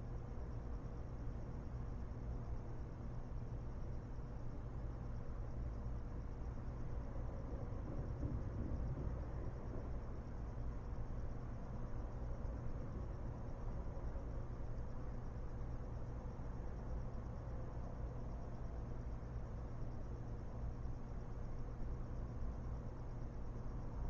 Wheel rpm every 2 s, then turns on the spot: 0, 0, 0, 0, 0, 0, 0, 0, 0, 0, 0, 0.
none